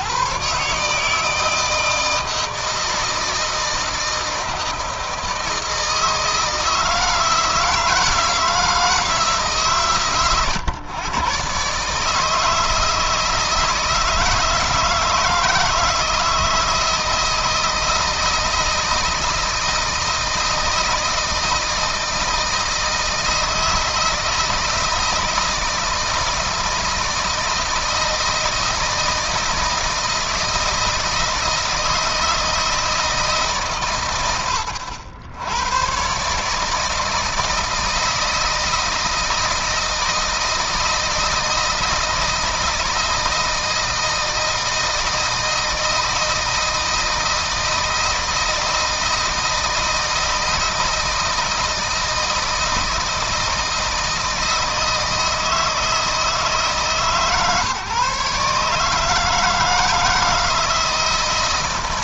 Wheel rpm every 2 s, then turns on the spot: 140, 160, 160, 160, 160, 120, 160, 160, 160, 160, 160, 160, 160, 160, 160, 160, 160, 100, 150, 160, 160, 160, 160, 160, 160, 160, 160, 160, 160, 150, 160.
none